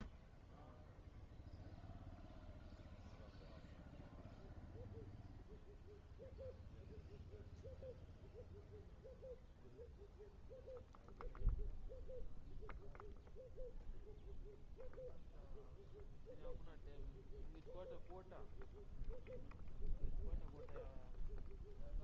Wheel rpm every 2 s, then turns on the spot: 0, 0, 0, 0, 0, 0, 0, 0, 0, 0, 0.
none